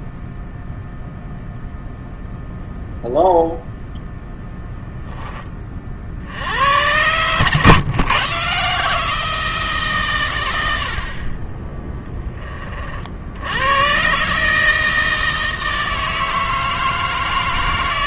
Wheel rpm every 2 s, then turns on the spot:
0, 0, 0, 100, 150, 80, 50, 160, 160.
none